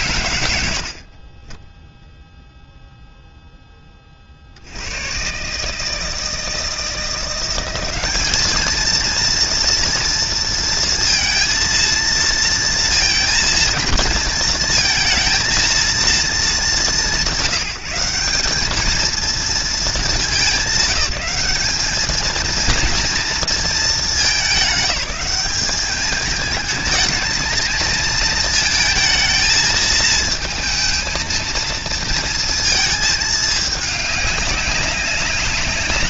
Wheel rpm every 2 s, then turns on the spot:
30, 30, 160, 200, 230, 230, 220, 220, 190, 210, 210, 220, 210, 230, 220, 230, 200, 190.
none